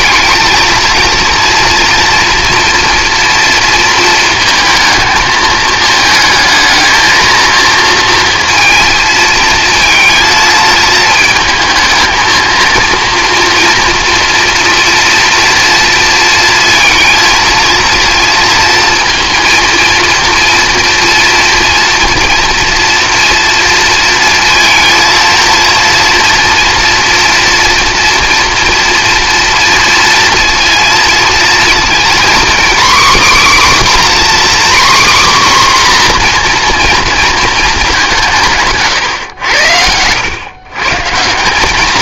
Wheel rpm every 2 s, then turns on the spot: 230, 240, 220, 220, 230, 220, 230, 240, 230, 230, 230, 230, 230, 240, 240, 230, 260, 270, 240, 140, 140.
none